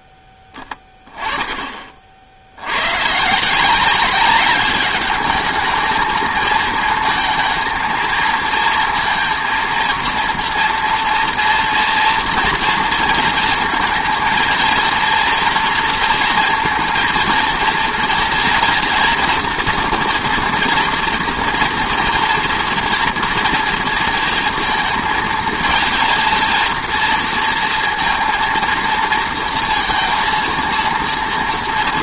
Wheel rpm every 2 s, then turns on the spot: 10, 100, 200, 220, 220, 230, 230, 230, 230, 230, 230, 230, 230, 230, 230, 230.
none